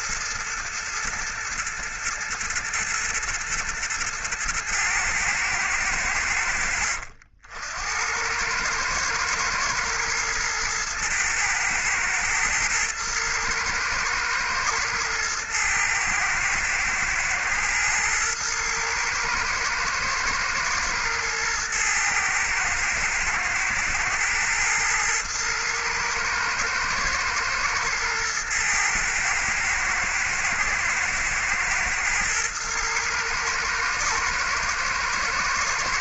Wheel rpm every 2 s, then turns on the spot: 120, 110, 120, 80, 110, 120, 120, 110, 110, 110, 110, 110, 110, 110, 110, 120, 110, 110.
none